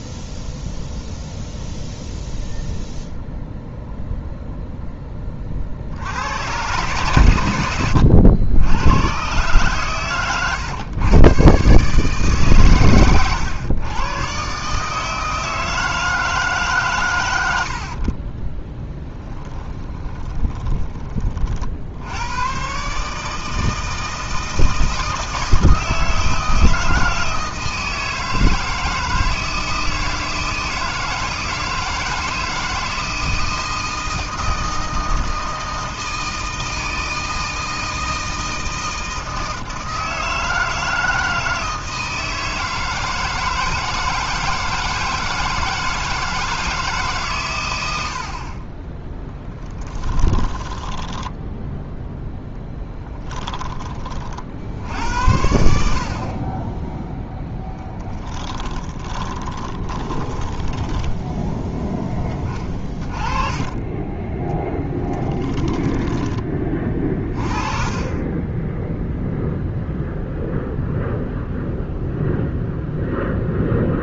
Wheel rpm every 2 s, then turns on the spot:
0, 0, 0, 110, 100, 120, 140, 140, 140, 30, 20, 130, 160, 160, 160, 160, 160, 160, 160, 160, 160, 160, 160, 160, 30, 20, 10, 70, 20, 20, 10, 20, 10, 20, 10, 0, 0.
18-20 50-54 58-62